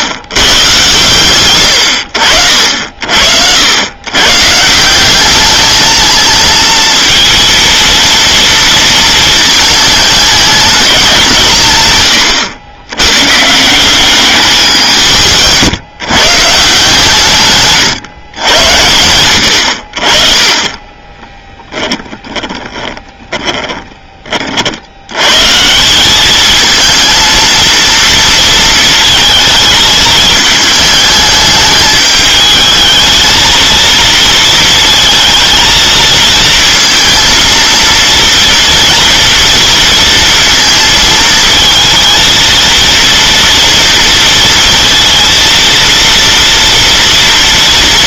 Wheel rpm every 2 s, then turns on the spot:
120, 70, 140, 230, 230, 210, 110, 200, 140, 110, 20, 20, 40, 220, 230, 210, 220, 230, 230, 230, 230, 230, 230, 230.
22-24